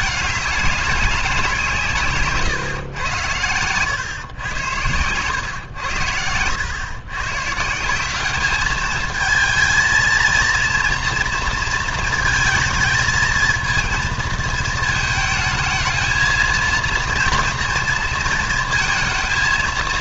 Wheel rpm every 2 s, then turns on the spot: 210, 140, 110, 100, 210, 230, 230, 220, 230, 230.
2-4